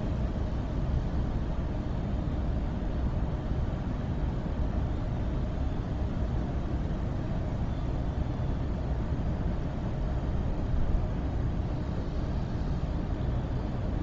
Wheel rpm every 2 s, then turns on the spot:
0, 0, 0, 0, 0, 0, 0.
none